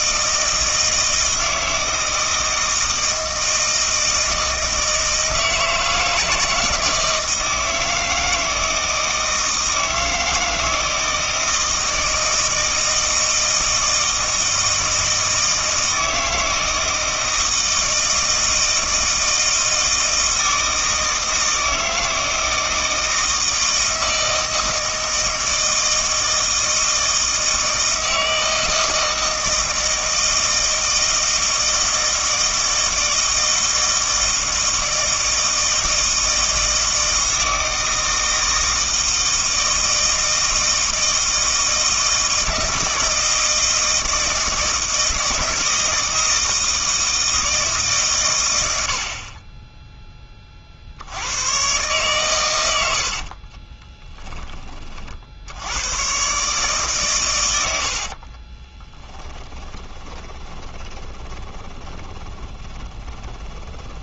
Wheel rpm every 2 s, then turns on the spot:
160, 160, 160, 160, 160, 160, 160, 160, 160, 160, 160, 160, 160, 160, 160, 160, 160, 160, 160, 160, 160, 160, 160, 160, 90, 50, 110, 30, 140, 20, 20, 10.
58-64